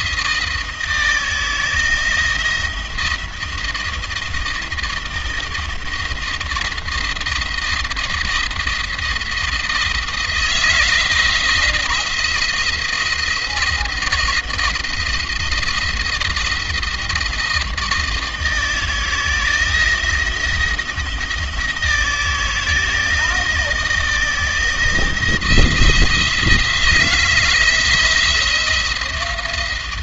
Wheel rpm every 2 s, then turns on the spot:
160, 170, 160, 170, 170, 170, 170, 170, 170, 160, 160, 160, 170, 160, 170.
none